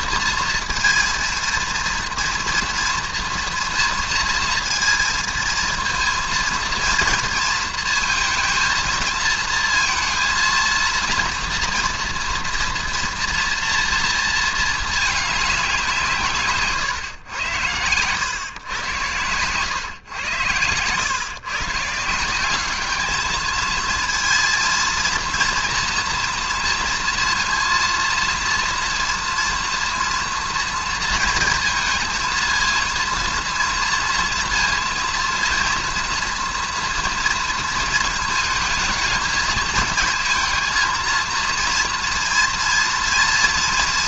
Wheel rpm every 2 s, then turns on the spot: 230, 230, 230, 230, 230, 230, 230, 220, 130, 110, 110, 200, 230, 230, 230, 230, 230, 230, 230, 220, 220, 230.
none